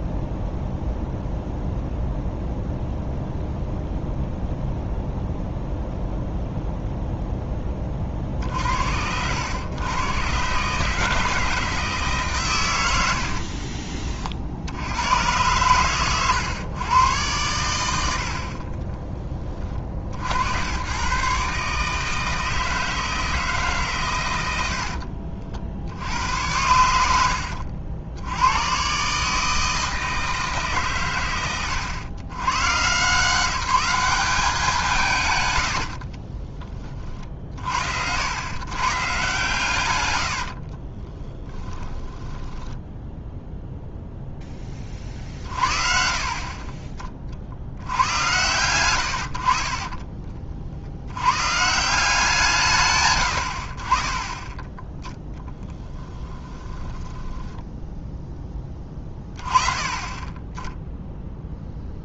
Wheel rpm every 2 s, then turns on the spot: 0, 0, 0, 0, 60, 140, 110, 70, 110, 40, 100, 160, 80, 90, 100, 140, 120, 180, 30, 130, 50, 10, 20, 40, 110, 60, 150, 10, 10, 10, 10.
18-20 24-26 40-42 46-48 56-58